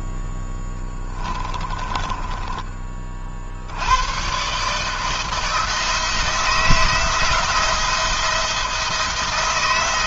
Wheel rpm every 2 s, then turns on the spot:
10, 30, 140, 170, 170.
0-2